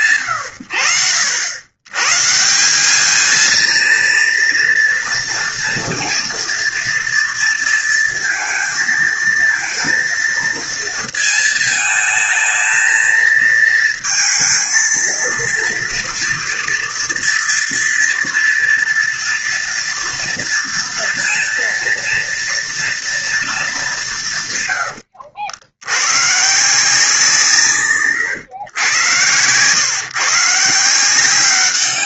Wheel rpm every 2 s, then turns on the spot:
80, 220, 230, 230, 230, 230, 220, 230, 240, 230, 240, 230, 90, 160, 110, 170.
none